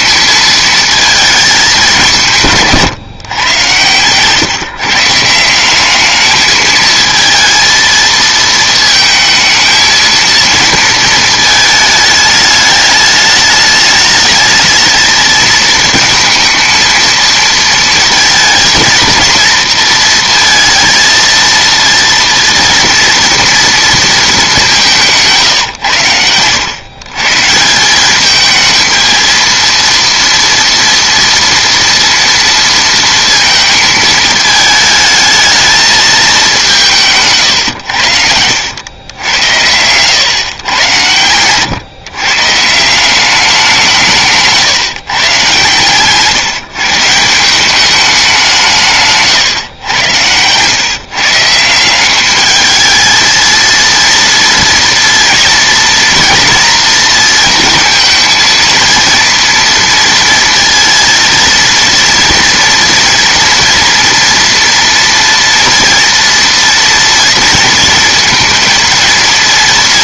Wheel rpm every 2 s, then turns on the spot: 220, 170, 150, 220, 220, 230, 210, 220, 230, 230, 230, 230, 190, 100, 220, 230, 230, 220, 200, 100, 110, 150, 150, 150, 180, 110, 210, 240, 230, 230, 230, 230, 230, 230, 230.
none